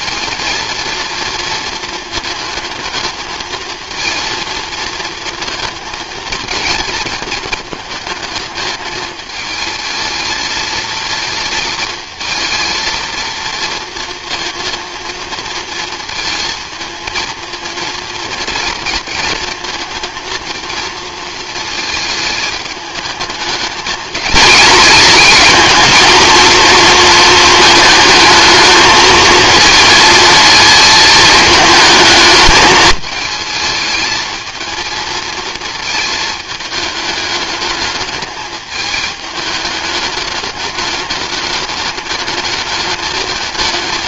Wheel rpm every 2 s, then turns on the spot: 230, 220, 230, 230, 220, 230, 230, 230, 220, 230, 230, 210, 220, 230, 220, 220, 210, 220, 220, 210, 210, 210.
none